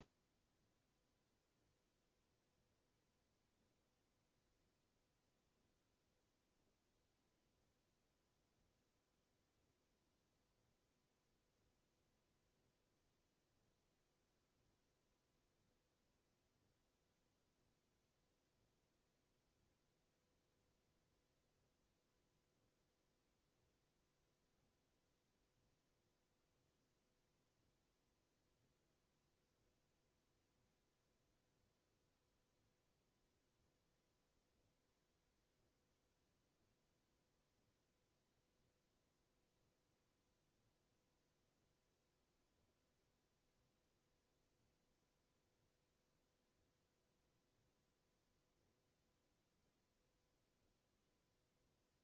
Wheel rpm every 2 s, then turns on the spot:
0, 0, 0, 0, 0, 0, 0, 0, 0, 0, 0, 0, 0, 0, 0, 0, 0, 0, 0, 0, 0, 0, 0, 0, 0, 0.
none